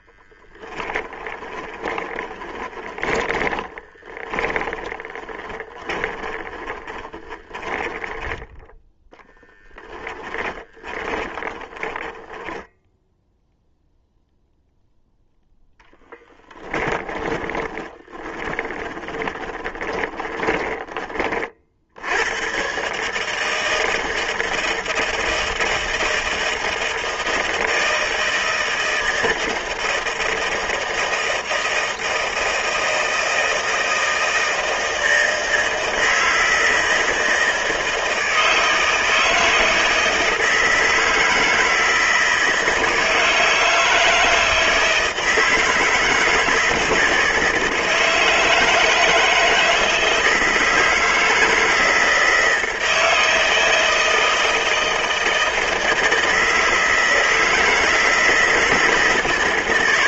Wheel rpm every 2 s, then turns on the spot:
20, 20, 20, 20, 0, 10, 10, 0, 10, 20, 20, 130, 160, 160, 160, 160, 160, 160, 160, 160, 160, 160, 160, 160, 160, 160, 160, 160, 160, 160.
0-8 10-12 16-22